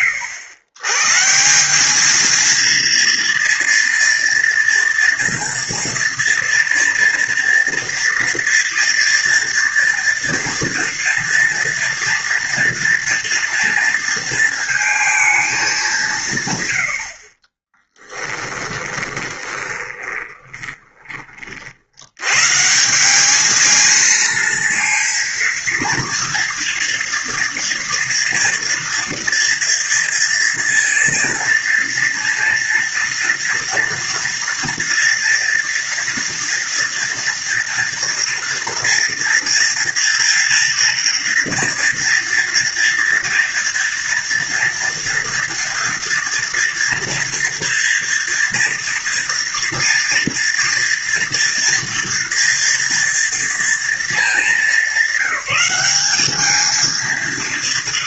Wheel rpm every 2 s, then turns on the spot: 110, 230, 230, 230, 240, 230, 230, 220, 80, 20, 20, 170, 230, 230, 230, 230, 230, 230, 230, 230, 240, 230, 230, 240, 230, 230, 230, 200, 220.
18-22